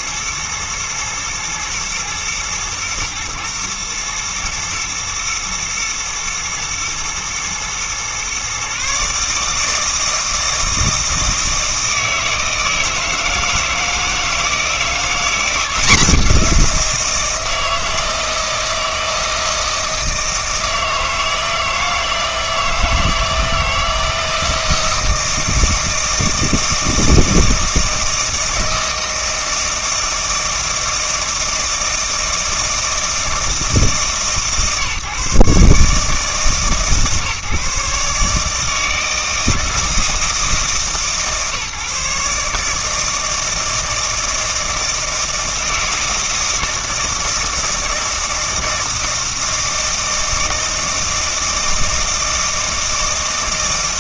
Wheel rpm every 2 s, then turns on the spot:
110, 110, 120, 110, 130, 160, 160, 170, 180, 160, 160, 160, 160, 160, 160, 160, 160, 140, 150, 150, 160, 150, 160, 160, 160, 160, 160.
none